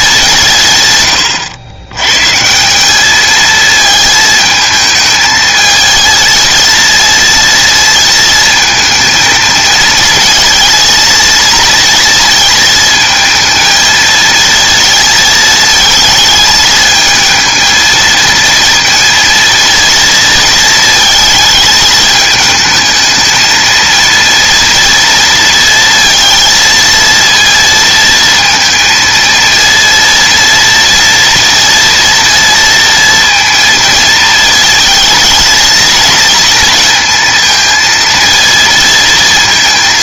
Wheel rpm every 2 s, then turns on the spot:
140, 160, 220, 230, 230, 220, 230, 230, 220, 230, 220, 220, 230, 230, 230, 230, 230, 220, 230, 230.
none